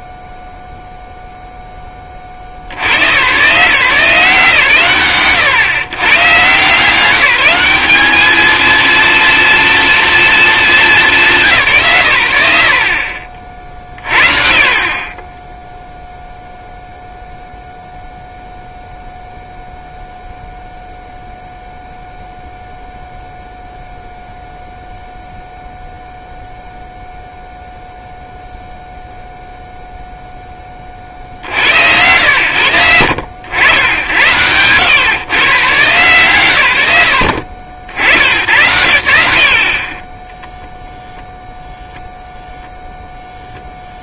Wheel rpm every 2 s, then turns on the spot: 0, 80, 130, 160, 230, 220, 80, 50, 0, 0, 0, 0, 0, 0, 0, 20, 90, 110, 110, 100, 0, 0.
none